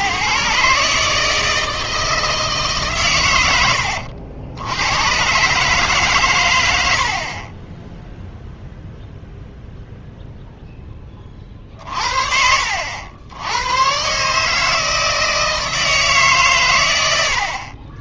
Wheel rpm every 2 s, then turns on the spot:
150, 150, 80, 100, 0, 0, 70, 150, 130.
none